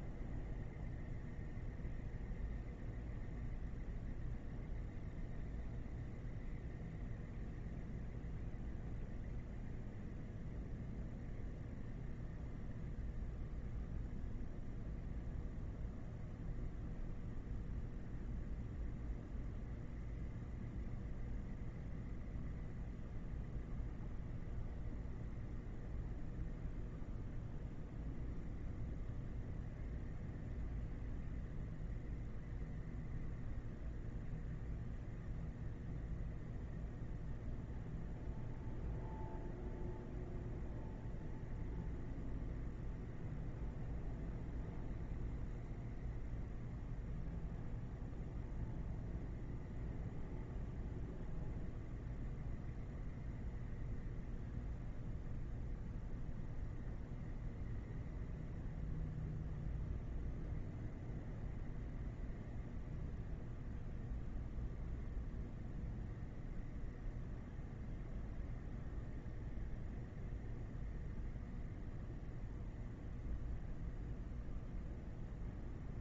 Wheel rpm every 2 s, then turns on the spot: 0, 0, 0, 0, 0, 0, 0, 0, 0, 0, 0, 0, 0, 0, 0, 0, 0, 0, 0, 0, 0, 0, 0, 0, 0, 0, 0, 0, 0, 0, 0, 0, 0, 0, 0, 0, 0, 0.
none